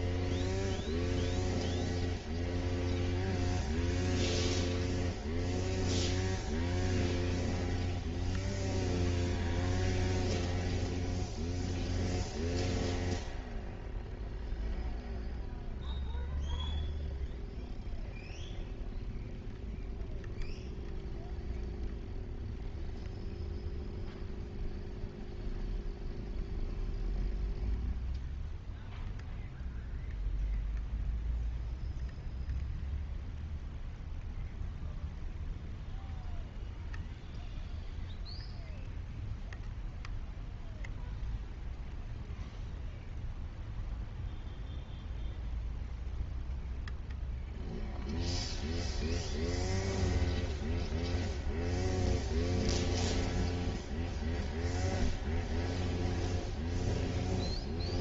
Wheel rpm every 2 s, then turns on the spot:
0, 0, 0, 0, 0, 0, 0, 0, 0, 0, 0, 0, 0, 0, 0, 0, 0, 0, 0, 0, 0, 0, 0, 0, 0, 0, 0, 0, 0.
none